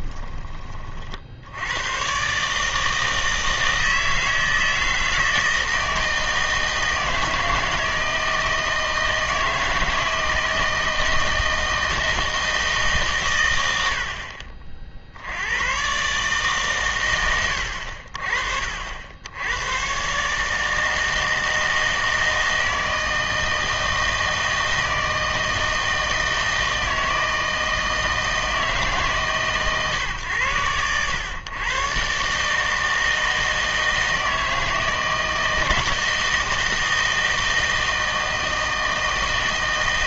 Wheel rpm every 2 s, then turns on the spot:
30, 150, 160, 160, 160, 160, 160, 50, 130, 50, 160, 160, 160, 160, 160, 110, 150, 160, 160, 160.
none